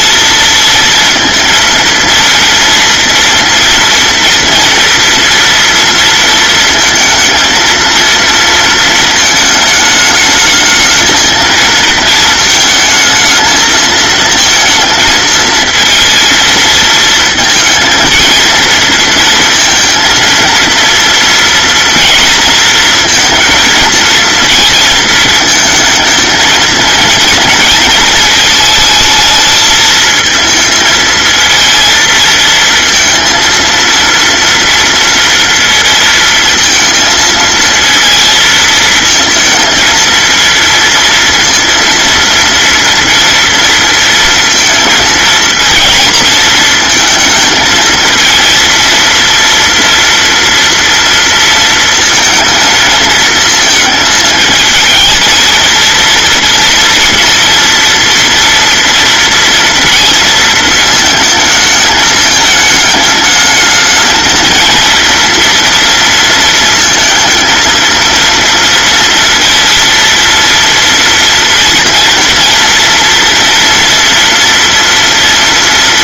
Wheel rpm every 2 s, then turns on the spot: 230, 230, 230, 220, 230, 220, 220, 230, 230, 230, 230, 230, 230, 230, 220, 220, 230, 230, 230, 220, 230, 240, 230, 220, 230, 230, 230, 220, 230, 230, 220, 210, 230, 230, 230, 230, 230, 230.
none